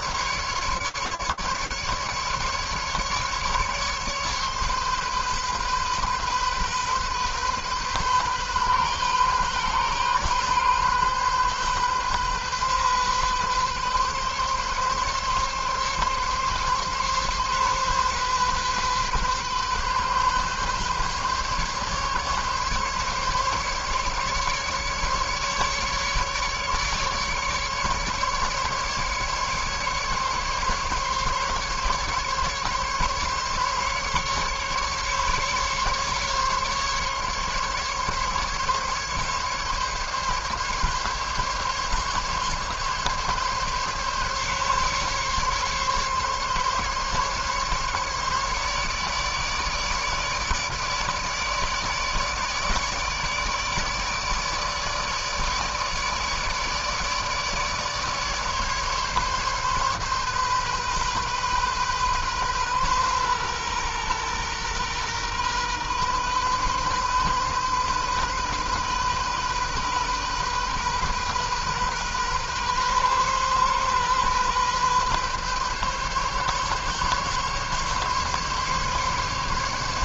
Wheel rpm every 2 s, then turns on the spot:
150, 150, 140, 130, 130, 130, 130, 140, 130, 130, 140, 140, 150, 150, 150, 140, 140, 140, 140, 140, 140, 140, 140, 140, 150, 150, 150, 150, 150, 150, 130, 130, 120, 130, 130, 130, 130, 130, 140, 140.
none